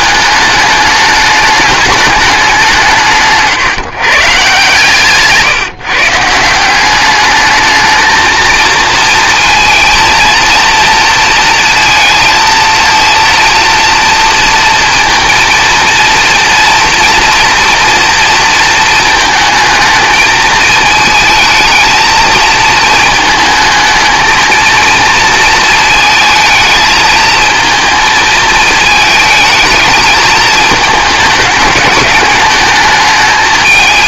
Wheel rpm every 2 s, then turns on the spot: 210, 170, 150, 190, 230, 230, 230, 230, 230, 220, 220, 220, 230, 220, 220, 210, 210.
4-6